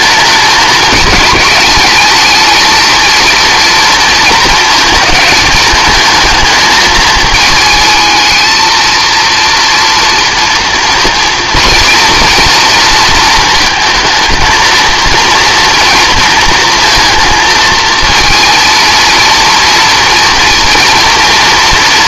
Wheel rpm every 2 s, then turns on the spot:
220, 220, 220, 220, 220, 240, 230, 230, 230, 230, 230.
none